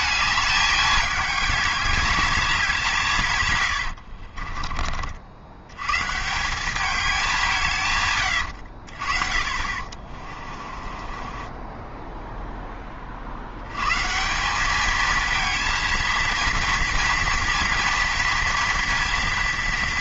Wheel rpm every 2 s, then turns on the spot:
210, 190, 30, 190, 90, 30, 10, 200, 230, 230.
4-6 8-12